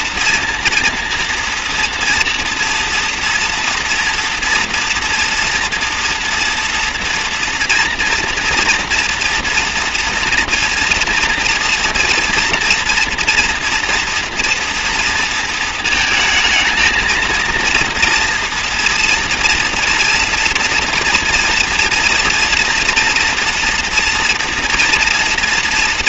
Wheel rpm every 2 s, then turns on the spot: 230, 230, 230, 230, 230, 230, 230, 230, 220, 230, 230, 230, 240.
none